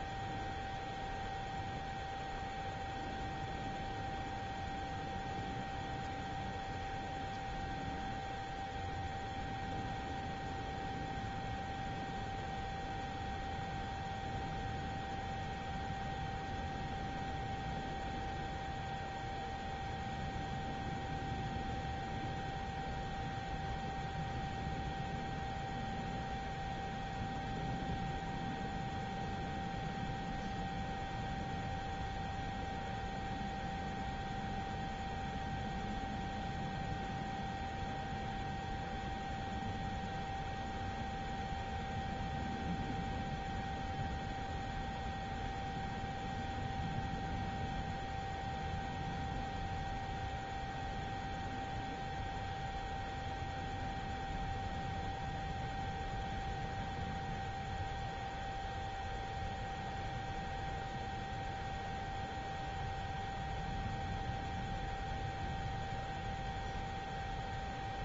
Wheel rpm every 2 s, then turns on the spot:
0, 0, 0, 0, 0, 0, 0, 0, 0, 0, 0, 0, 0, 0, 0, 0, 0, 0, 0, 0, 0, 0, 0, 0, 0, 0, 0, 0, 0, 0, 0, 0, 0, 0.
none